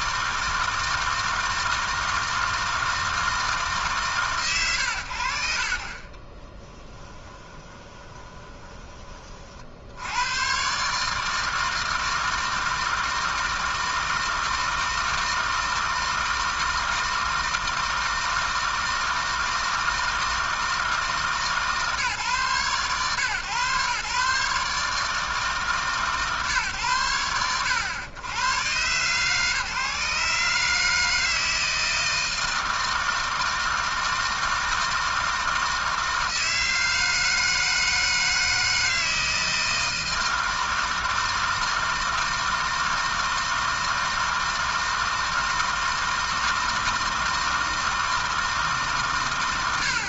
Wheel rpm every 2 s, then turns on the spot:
160, 160, 90, 20, 20, 130, 160, 160, 160, 160, 160, 130, 150, 110, 120, 150, 160, 160, 160, 160, 160, 160, 160, 160, 150.
6-10